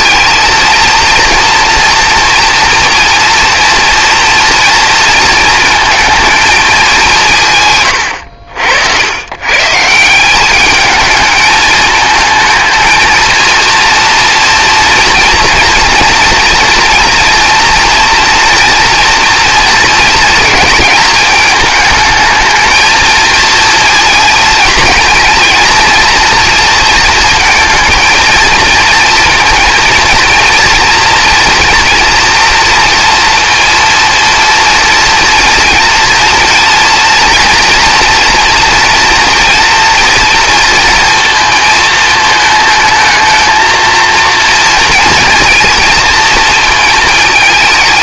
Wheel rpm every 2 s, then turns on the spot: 230, 240, 230, 200, 80, 210, 220, 230, 230, 230, 220, 220, 220, 230, 230, 230, 230, 230, 240, 230, 230, 220, 230, 230.
none